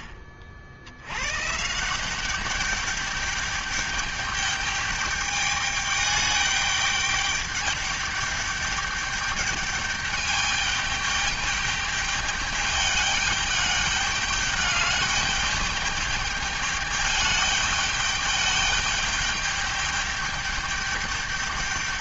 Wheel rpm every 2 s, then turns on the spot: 80, 210, 210, 210, 210, 210, 210, 200, 210, 210, 210.
none